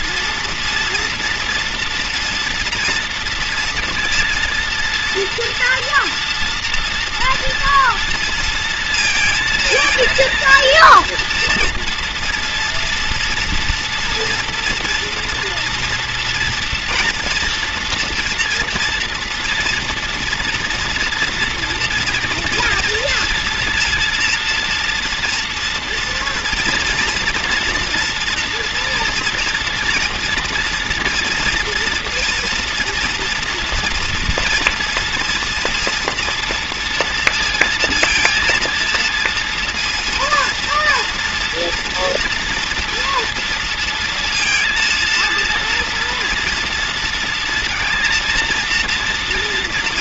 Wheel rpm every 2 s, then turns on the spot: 230, 230, 230, 230, 230, 230, 230, 240, 240, 230, 230, 230, 230, 230, 230, 240, 230, 230, 230, 230, 230, 230, 230, 240, 230.
none